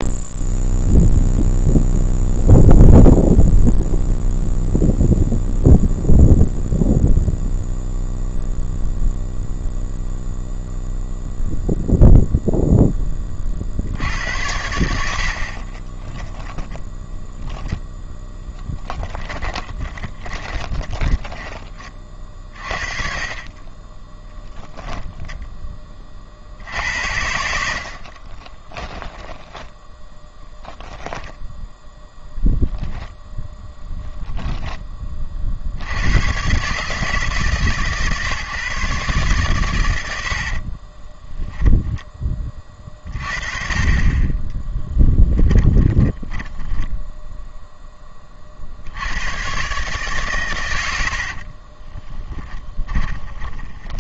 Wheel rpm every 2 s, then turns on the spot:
0, 0, 0, 0, 0, 0, 10, 80, 10, 10, 20, 30, 10, 70, 20, 0, 0, 10, 140, 150, 40, 30, 10, 0, 70, 90, 20.
18-22 28-30 40-42 44-46 50-54